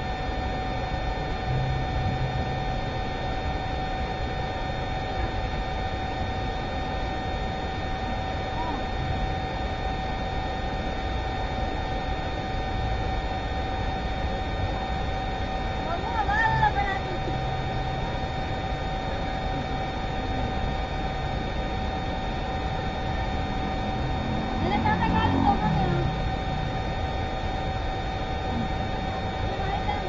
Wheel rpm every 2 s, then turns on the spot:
0, 0, 0, 0, 0, 0, 0, 0, 0, 0, 0, 0, 0, 0, 0.
none